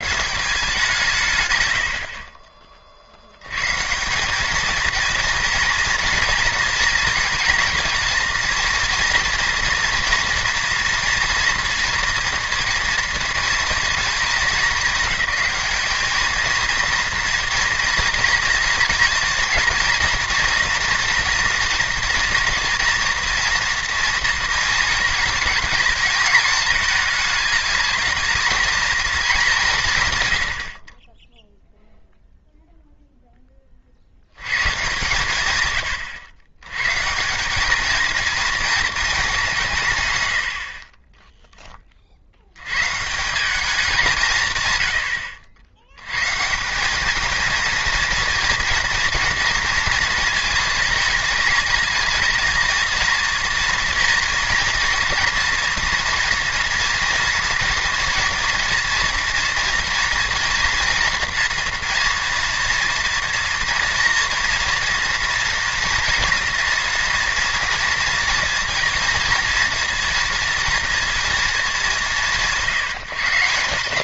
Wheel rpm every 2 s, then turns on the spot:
170, 40, 230, 230, 230, 230, 230, 210, 230, 240, 230, 230, 220, 210, 220, 60, 0, 120, 110, 230, 60, 140, 100, 190, 230, 220, 230, 230, 240, 230, 230, 230, 230, 230, 230, 230, 160.
40-42